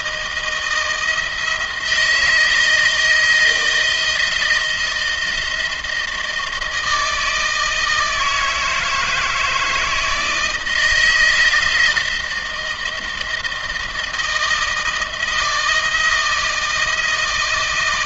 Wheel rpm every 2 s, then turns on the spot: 160, 160, 170, 160, 160, 160, 160, 160, 160.
none